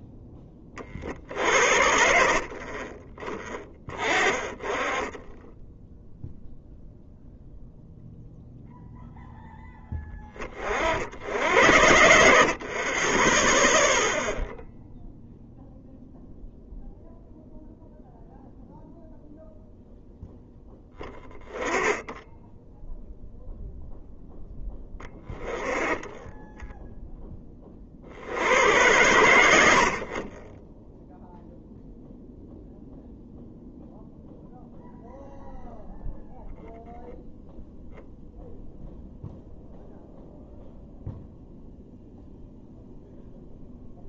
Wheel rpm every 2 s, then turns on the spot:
10, 50, 30, 0, 0, 40, 60, 0, 0, 0, 0, 10, 10, 10, 80, 20, 0, 0, 0, 0, 0, 0.
none